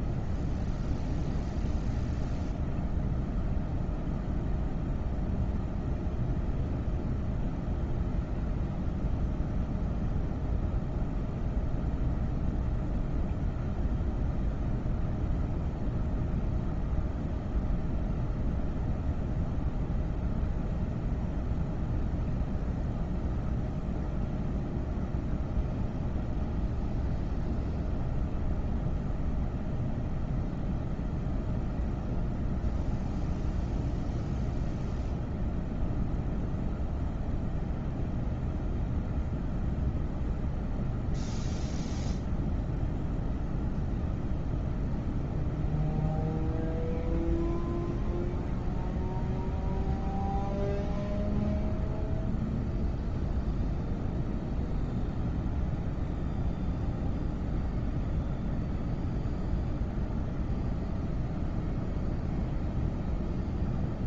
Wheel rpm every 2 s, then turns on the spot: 0, 0, 0, 0, 0, 0, 0, 0, 0, 0, 0, 0, 0, 0, 0, 0, 0, 0, 0, 0, 0, 0, 0, 0, 0, 0, 0, 0, 0, 0, 0, 0.
none